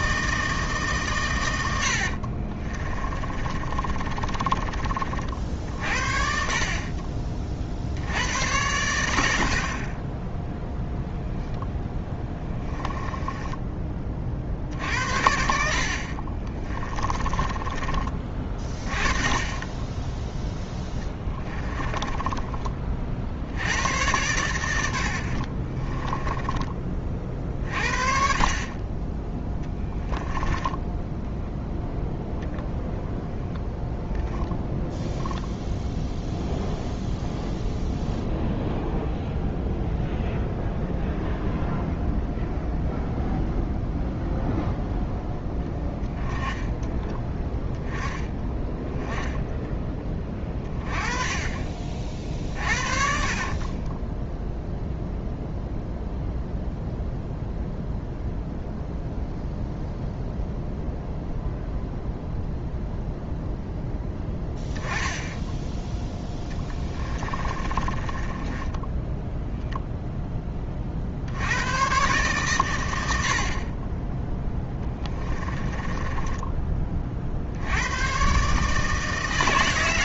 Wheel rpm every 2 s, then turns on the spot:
150, 30, 30, 40, 100, 0, 10, 60, 20, 20, 20, 30, 90, 30, 30, 10, 0, 0, 0, 0, 0, 0, 0, 10, 10, 30, 40, 0, 0, 0, 0, 0, 10, 20, 10, 40, 100, 10, 30, 160.
2-4 12-14 16-18 20-22 30-32 52-54 66-70 74-76